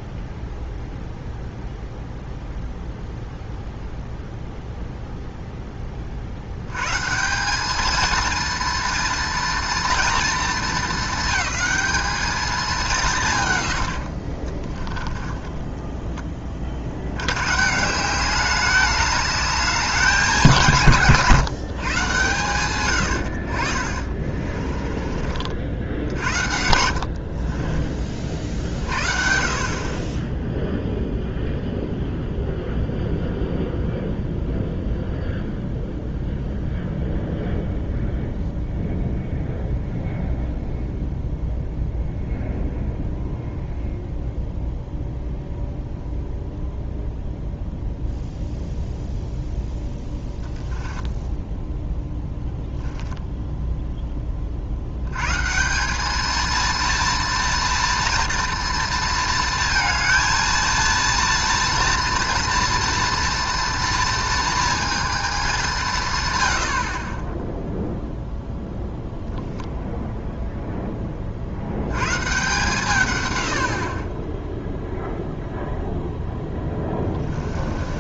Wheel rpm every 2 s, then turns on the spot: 0, 0, 0, 120, 230, 220, 190, 20, 60, 210, 160, 100, 40, 60, 60, 0, 0, 0, 0, 0, 0, 0, 0, 0, 0, 10, 10, 70, 230, 230, 230, 230, 230, 60, 0, 10, 140, 0, 10.
14-16 24-28 50-52 76-78